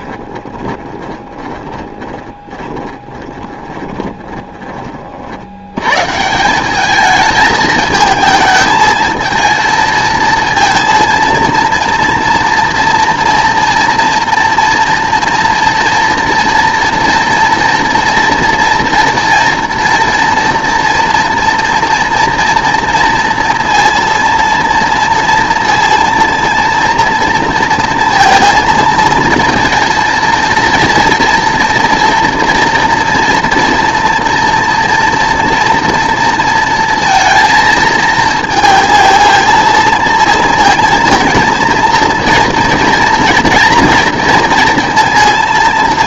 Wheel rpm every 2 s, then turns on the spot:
20, 20, 40, 210, 220, 230, 230, 230, 230, 240, 230, 230, 230, 230, 230, 240, 230, 230, 230, 220, 230, 240, 230.
0-4